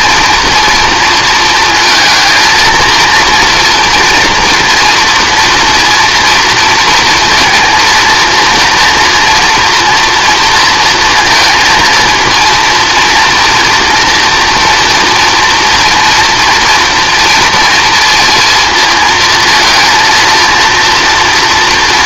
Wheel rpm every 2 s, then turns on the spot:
230, 230, 230, 230, 240, 230, 230, 240, 230, 230, 230.
none